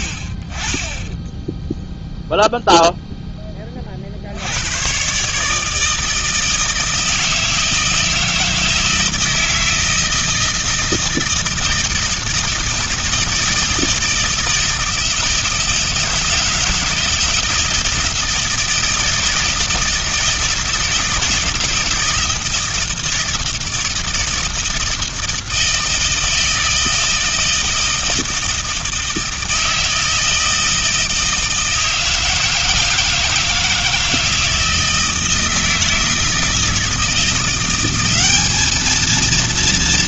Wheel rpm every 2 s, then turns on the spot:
50, 0, 80, 160, 160, 160, 160, 160, 160, 160, 160, 160, 160, 160, 160, 160, 160, 160, 160, 210.
none